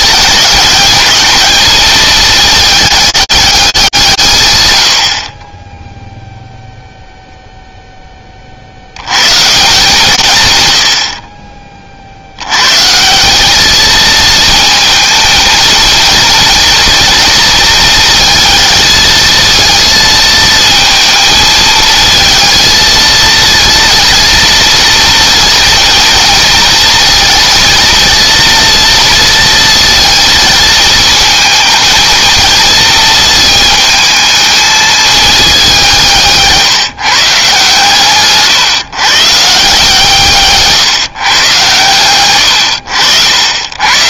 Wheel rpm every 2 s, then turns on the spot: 210, 220, 100, 0, 60, 110, 130, 220, 230, 230, 220, 220, 230, 230, 230, 220, 220, 220, 150, 140, 150, 90.
40-42